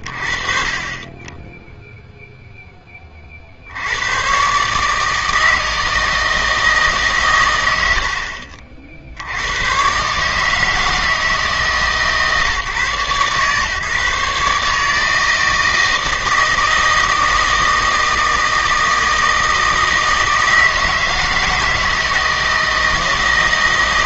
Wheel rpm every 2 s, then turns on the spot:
40, 10, 140, 160, 60, 160, 150, 150, 160, 160, 160, 160.
none